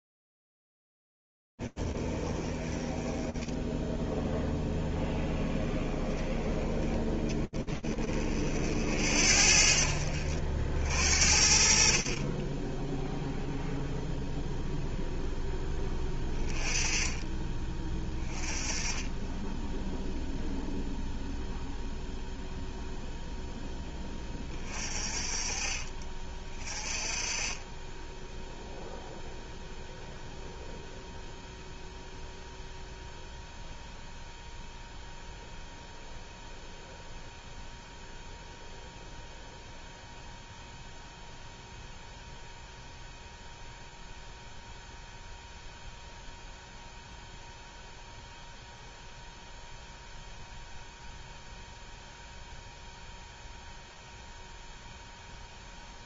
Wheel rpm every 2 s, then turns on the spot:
0, 20, 0, 10, 30, 60, 40, 0, 20, 20, 0, 0, 30, 20, 0, 0, 0, 0, 0, 0, 0, 0, 0, 0, 0, 0, 0, 0.
none